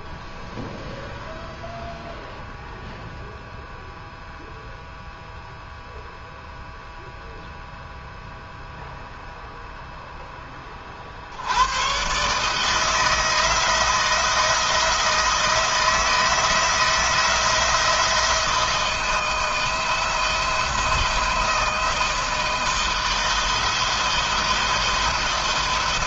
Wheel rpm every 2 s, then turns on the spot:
0, 0, 0, 0, 0, 30, 160, 160, 170, 170, 170, 160, 170.
none